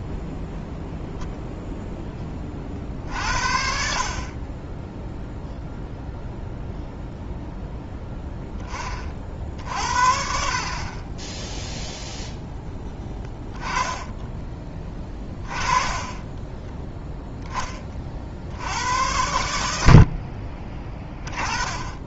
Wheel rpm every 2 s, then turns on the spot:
0, 50, 10, 0, 20, 50, 0, 20, 10, 80, 20.
none